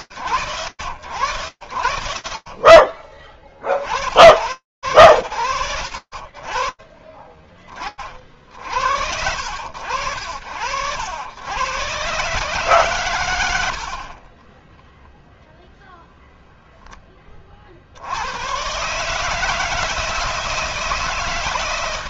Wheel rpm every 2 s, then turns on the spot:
40, 90, 40, 40, 60, 120, 30, 0, 80, 160, 160.
12-14